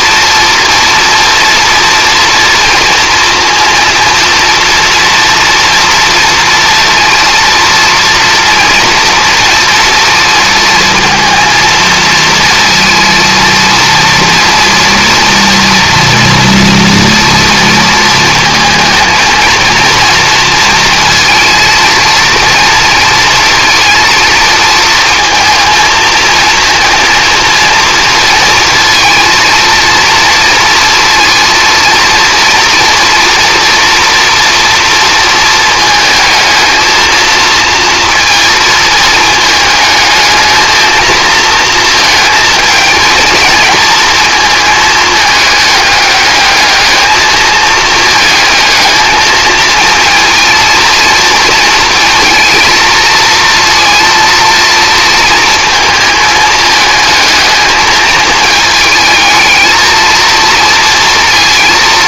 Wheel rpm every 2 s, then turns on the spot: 230, 230, 240, 230, 230, 230, 230, 230, 230, 230, 230, 230, 230, 230, 230, 230, 230, 230, 220, 220, 220, 220, 220, 210, 220, 230, 230, 230, 220, 220, 230.
none